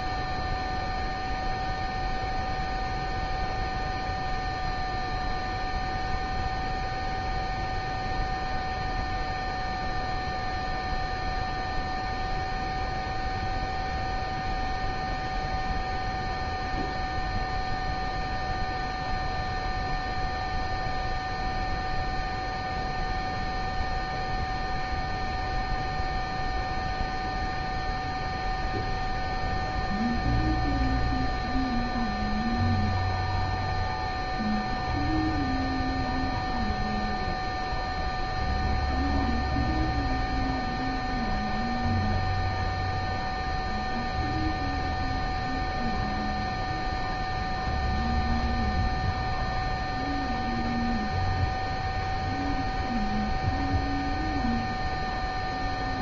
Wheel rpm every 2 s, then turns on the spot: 0, 0, 0, 0, 0, 0, 0, 0, 0, 0, 0, 0, 0, 0, 0, 0, 0, 0, 0, 0, 0, 0, 0, 0, 0, 0, 0, 0.
none